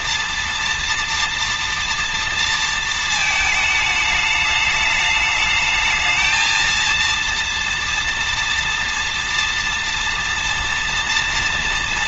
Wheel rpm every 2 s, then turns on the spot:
230, 230, 210, 230, 230, 230.
none